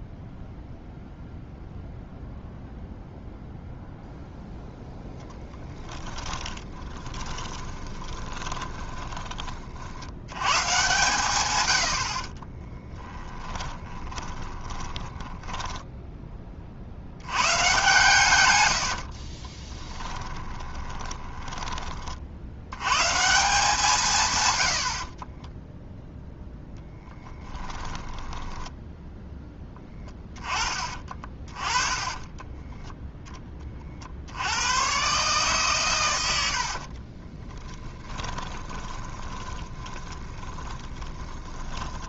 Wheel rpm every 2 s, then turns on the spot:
0, 0, 0, 20, 20, 120, 30, 20, 50, 90, 20, 80, 70, 0, 10, 20, 20, 100, 70, 20, 10.
6-10 12-16 18-22 28-30 32-34 36-42